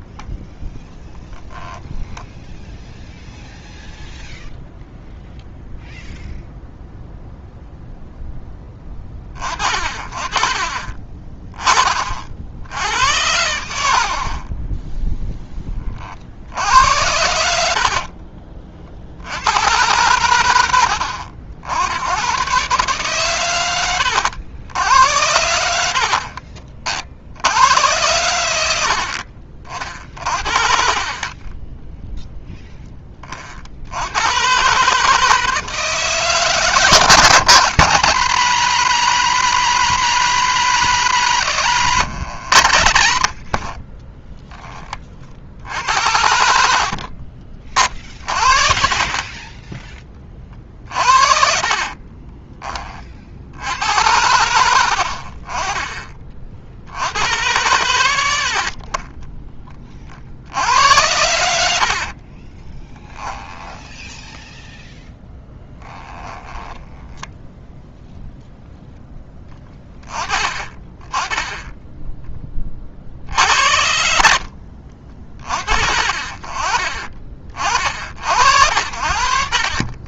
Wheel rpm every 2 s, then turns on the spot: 10, 0, 0, 0, 20, 20, 70, 10, 80, 40, 90, 130, 80, 50, 80, 60, 20, 140, 150, 190, 180, 100, 20, 60, 40, 40, 20, 70, 70, 40, 70, 20, 0, 10, 0, 20, 30, 60, 40, 60.
14-16 30-32 42-44 46-50 62-64 66-68 70-72 74-76